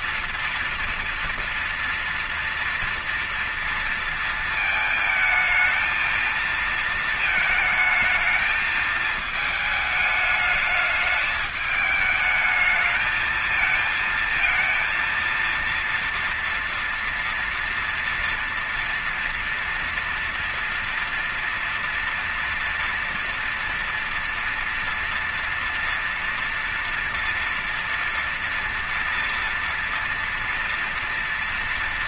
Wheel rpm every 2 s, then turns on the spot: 230, 230, 230, 220, 220, 210, 210, 220, 230, 230, 230, 230, 230, 230, 240, 230.
none